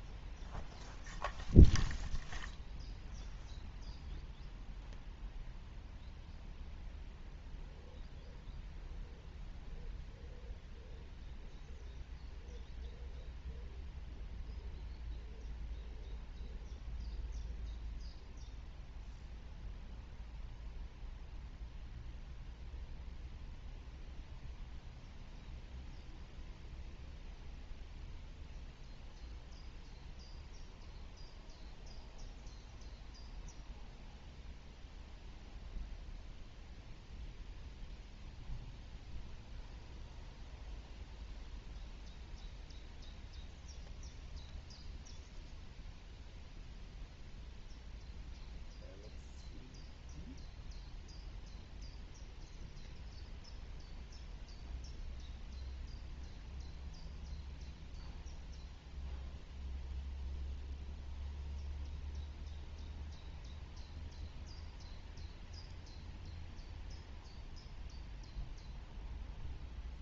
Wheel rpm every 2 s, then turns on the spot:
0, 0, 0, 0, 0, 0, 0, 0, 0, 0, 0, 0, 0, 0, 0, 0, 0, 0, 0, 0, 0, 0, 0, 0, 0, 0, 0, 0, 0, 0, 0, 0, 0, 0, 0.
none